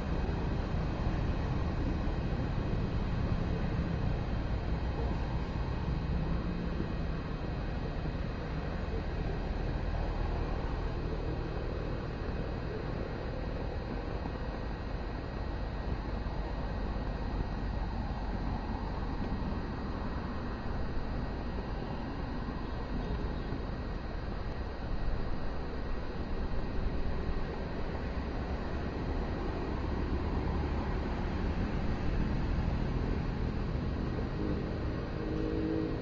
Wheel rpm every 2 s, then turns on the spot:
0, 0, 0, 0, 0, 0, 0, 0, 0, 0, 0, 0, 0, 0, 0, 0, 0, 0.
none